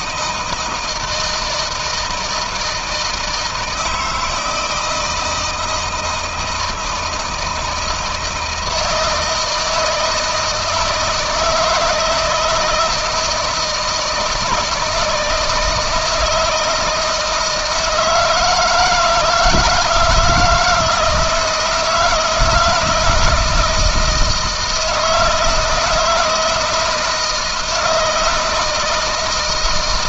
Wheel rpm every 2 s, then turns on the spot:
160, 160, 160, 160, 160, 160, 160, 160, 160, 160, 160, 170, 160, 160, 160.
none